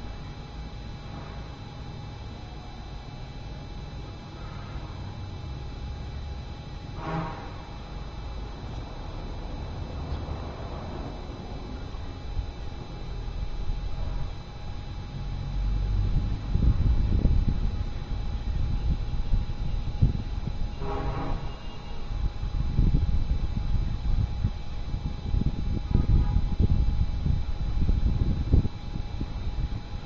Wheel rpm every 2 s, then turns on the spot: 0, 0, 0, 0, 0, 0, 0, 0, 0, 0, 0, 0, 0, 0, 0.
none